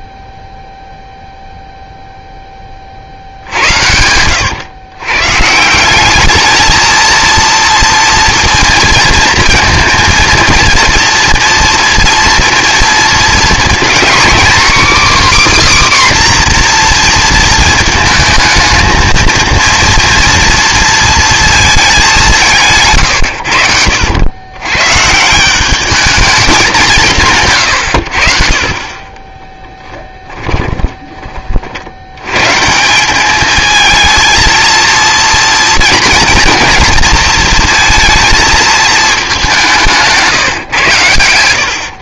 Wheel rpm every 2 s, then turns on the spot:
0, 30, 110, 220, 230, 230, 230, 270, 250, 220, 230, 170, 120, 200, 40, 10, 150, 230, 230, 220, 150.
30-32